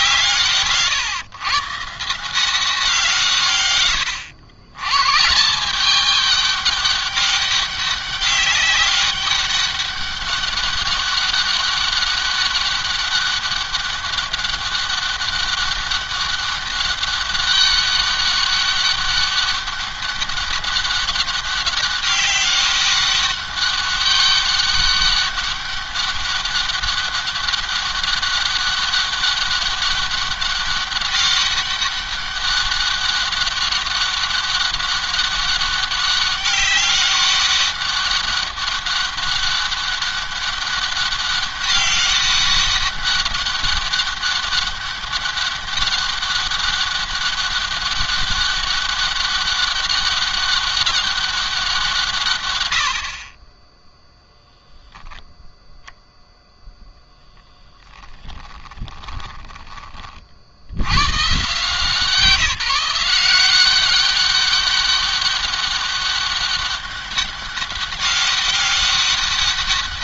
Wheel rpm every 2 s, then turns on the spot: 140, 170, 130, 200, 190, 200, 200, 200, 200, 200, 200, 200, 200, 200, 200, 200, 200, 200, 200, 200, 200, 200, 200, 200, 200, 200, 90, 0, 10, 20, 90, 170, 200, 200, 200.
58-60